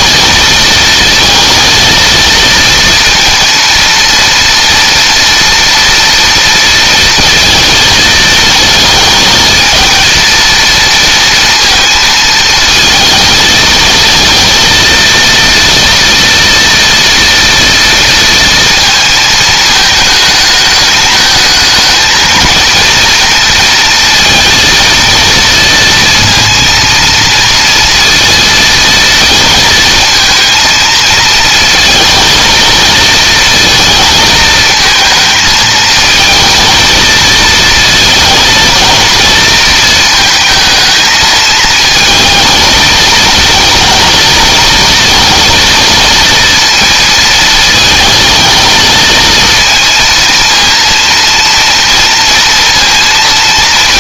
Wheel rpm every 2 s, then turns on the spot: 230, 230, 230, 230, 230, 230, 230, 230, 230, 230, 210, 230, 230, 230, 230, 220, 230, 220, 230, 230, 220, 220, 220, 230, 230, 230, 230.
none